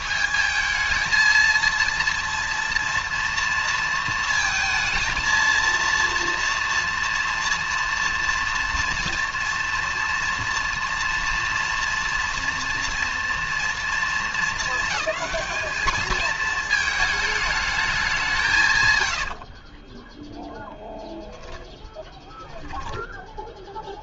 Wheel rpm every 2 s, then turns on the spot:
220, 230, 230, 230, 230, 230, 230, 220, 220, 140, 0, 10.
none